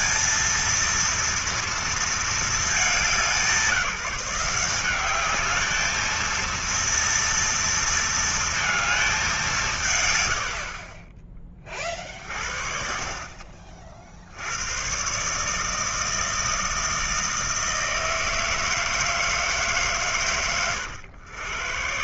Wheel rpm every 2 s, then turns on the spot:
230, 210, 180, 230, 230, 60, 60, 100, 160, 160, 120.
10-12